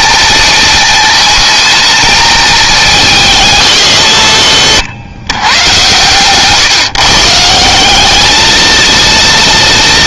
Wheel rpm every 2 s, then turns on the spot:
220, 200, 100, 140, 230.
none